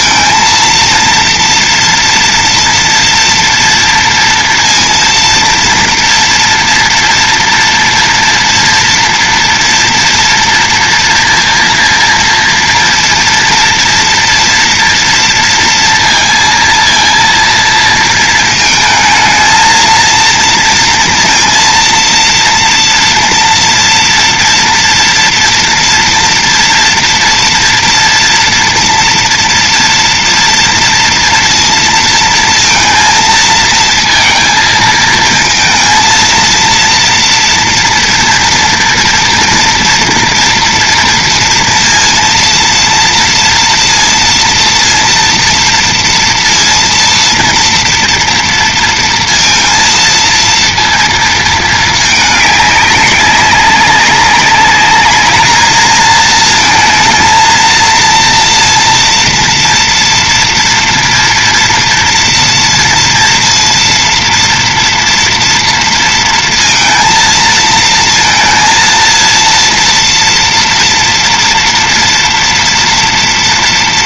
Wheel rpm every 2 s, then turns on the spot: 230, 230, 230, 230, 230, 230, 230, 240, 230, 220, 230, 240, 230, 230, 240, 230, 230, 230, 230, 230, 230, 230, 230, 230, 230, 230, 200, 200, 220, 230, 230, 230, 230, 230, 230, 230, 230.
none